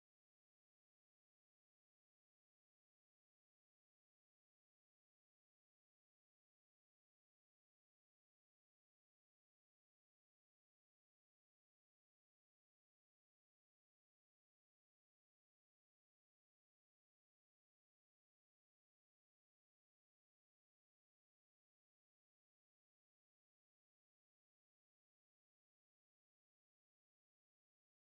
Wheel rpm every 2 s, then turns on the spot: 0, 0, 0, 0, 0, 0, 0, 0, 0, 0, 0, 0, 0, 0.
none